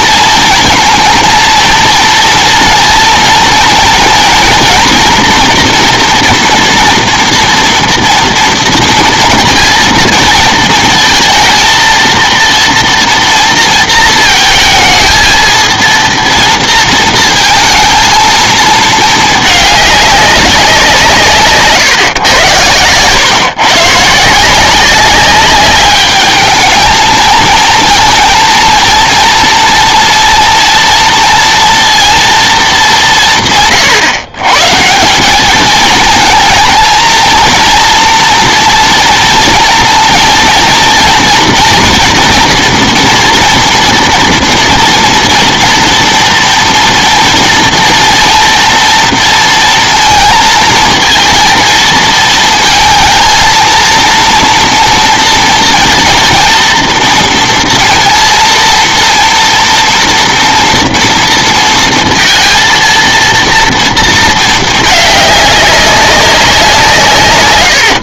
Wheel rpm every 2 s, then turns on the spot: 230, 230, 240, 230, 230, 220, 230, 220, 230, 220, 190, 120, 170, 220, 230, 230, 220, 150, 220, 230, 230, 240, 230, 230, 230, 230, 230, 230, 230, 230, 230, 230, 220, 180.
none